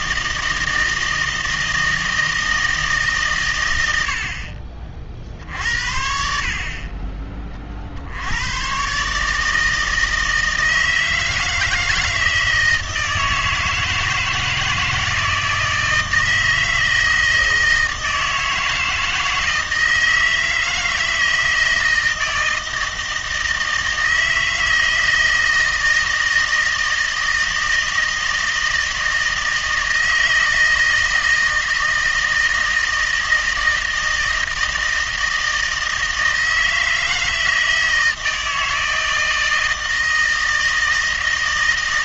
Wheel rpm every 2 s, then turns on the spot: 160, 160, 40, 50, 110, 160, 160, 160, 160, 160, 160, 160, 160, 160, 160, 160, 160, 160, 160, 160, 160.
none